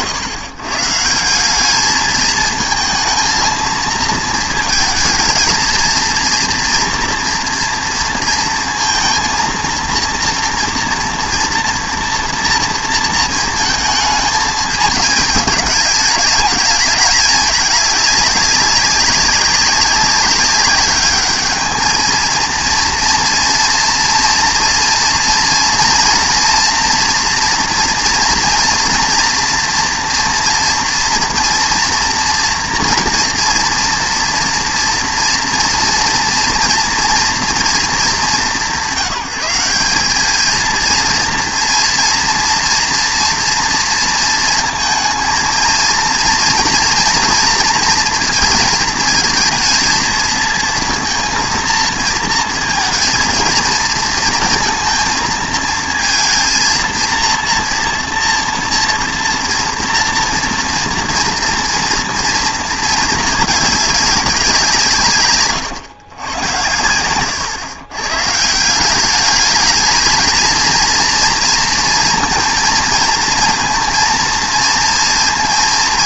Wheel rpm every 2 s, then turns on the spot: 130, 220, 220, 230, 230, 240, 230, 210, 210, 200, 200, 230, 230, 230, 230, 240, 230, 230, 230, 180, 220, 230, 220, 230, 220, 230, 230, 230, 230, 230, 230, 230, 160, 100, 180, 230, 240, 230.
none